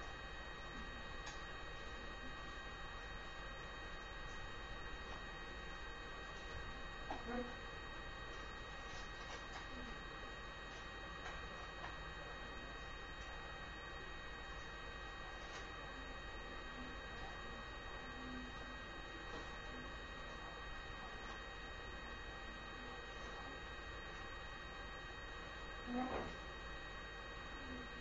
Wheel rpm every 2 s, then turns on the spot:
0, 0, 0, 0, 0, 0, 0, 0, 0, 0, 0, 0, 0, 0.
none